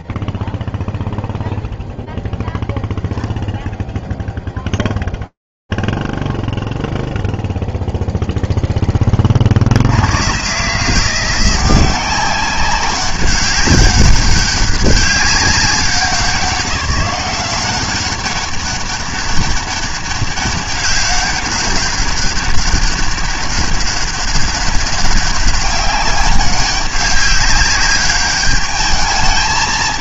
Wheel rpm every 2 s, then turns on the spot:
0, 0, 0, 0, 0, 120, 190, 200, 190, 190, 200, 200, 200, 200, 200.
none